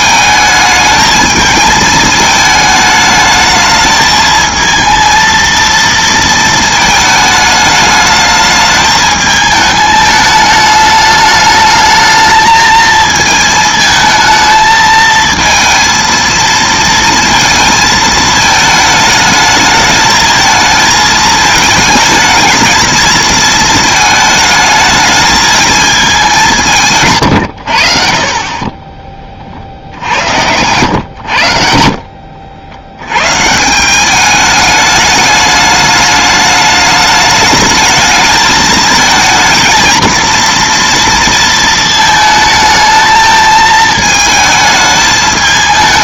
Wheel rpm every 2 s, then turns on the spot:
220, 220, 220, 220, 210, 210, 220, 220, 230, 220, 220, 220, 220, 160, 30, 90, 80, 210, 210, 220, 230, 220, 220.
none